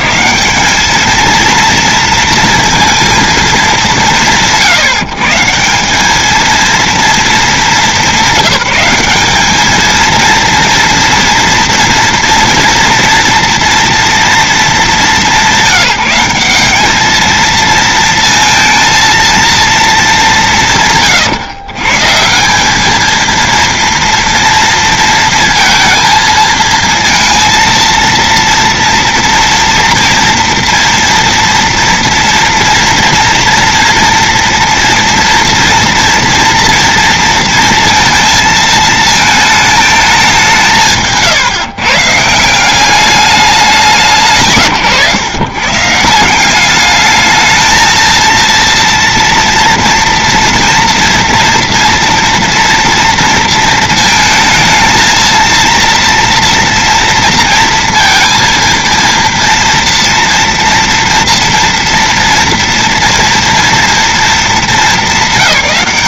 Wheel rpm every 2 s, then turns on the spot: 150, 230, 170, 200, 210, 230, 240, 240, 180, 230, 210, 150, 230, 230, 230, 240, 230, 240, 230, 230, 210, 150, 170, 160, 230, 230, 230, 230, 230, 230, 230, 230, 220.
none